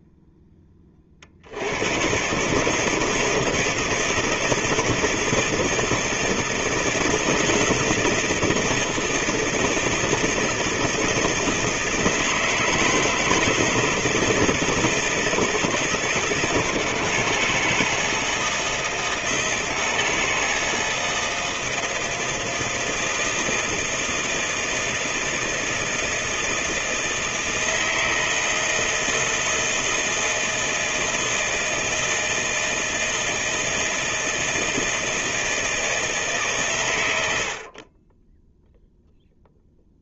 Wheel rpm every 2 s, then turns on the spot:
10, 140, 160, 160, 160, 160, 160, 160, 170, 160, 160, 160, 160, 160, 160, 160, 160, 160, 140, 10.
none